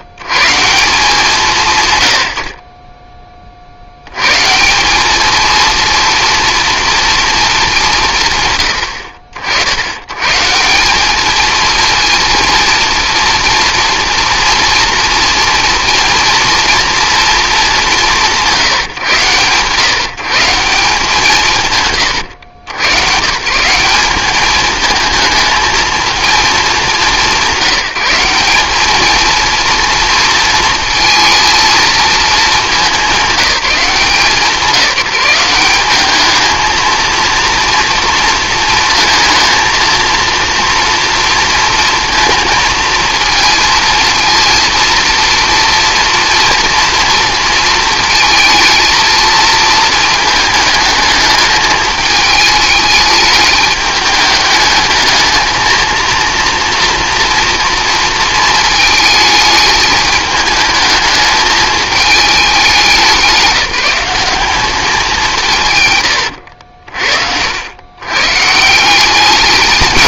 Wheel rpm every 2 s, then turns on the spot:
160, 40, 170, 230, 110, 180, 230, 230, 240, 160, 170, 110, 220, 210, 210, 230, 210, 180, 220, 230, 230, 230, 230, 230, 220, 210, 210, 210, 230, 220, 220, 200, 210, 80, 160.
66-68